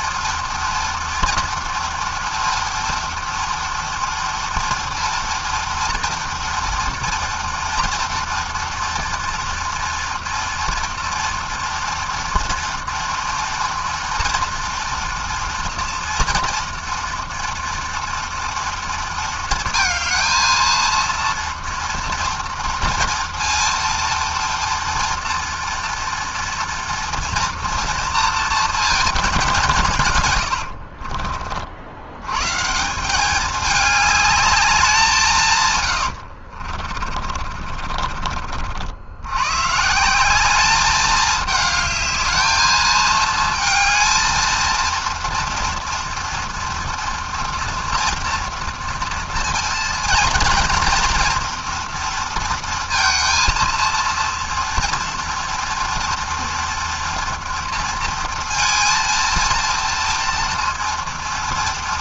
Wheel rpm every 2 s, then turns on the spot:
230, 230, 230, 240, 230, 240, 240, 230, 230, 230, 230, 230, 230, 230, 210, 40, 190, 170, 40, 100, 210, 220, 230, 230, 230, 230, 230, 230, 230, 230, 230.
36-38